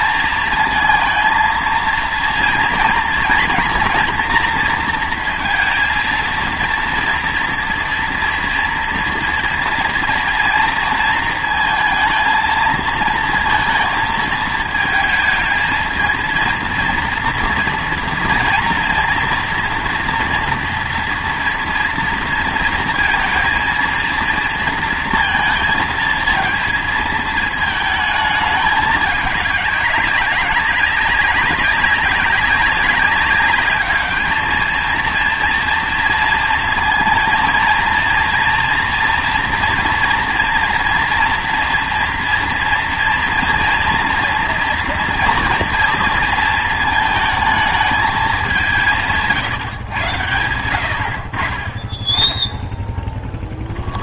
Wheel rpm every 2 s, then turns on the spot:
230, 230, 240, 230, 230, 230, 230, 220, 230, 230, 230, 230, 230, 230, 210, 200, 200, 220, 230, 230, 240, 230, 230, 220, 200, 90, 10.
none